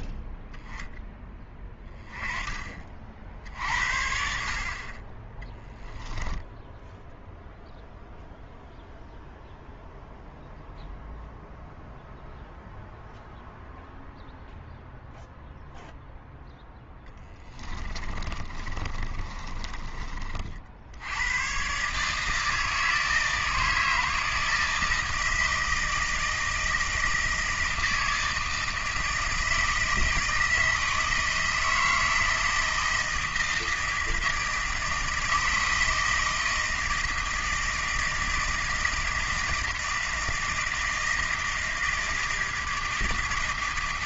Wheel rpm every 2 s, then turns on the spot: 10, 30, 60, 10, 0, 0, 0, 0, 0, 30, 50, 160, 160, 160, 160, 160, 160, 160, 160, 160, 160, 160.
18-20